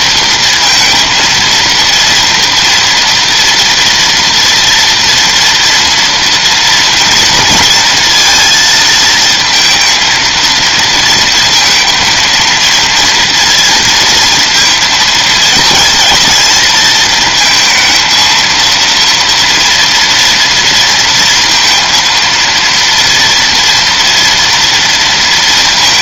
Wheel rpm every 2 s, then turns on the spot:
230, 230, 230, 230, 230, 230, 230, 230, 220, 230, 230, 230, 230.
none